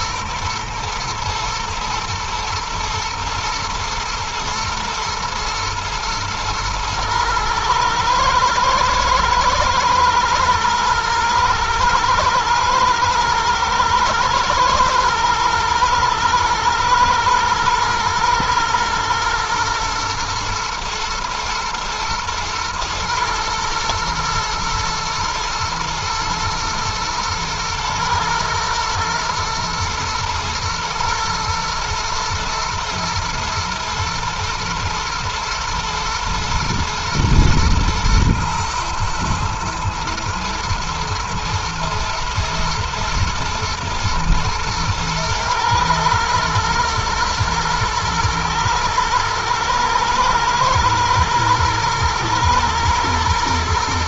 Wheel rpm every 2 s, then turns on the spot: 110, 110, 110, 120, 110, 120, 110, 120, 120, 120, 120, 120, 110, 120, 120, 110, 120, 110, 120, 110, 110, 120, 110, 120, 120, 110, 110.
none